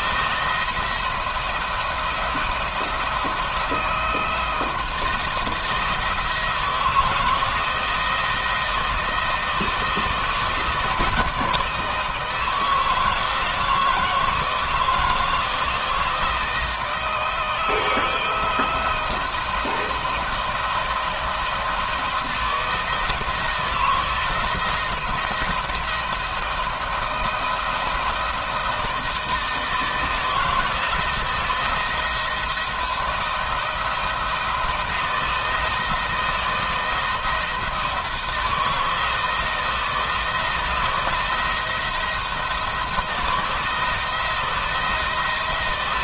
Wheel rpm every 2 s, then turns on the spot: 170, 170, 170, 160, 170, 160, 160, 160, 160, 160, 160, 170, 170, 170, 160, 160, 170, 170, 170, 170, 160, 160, 170.
none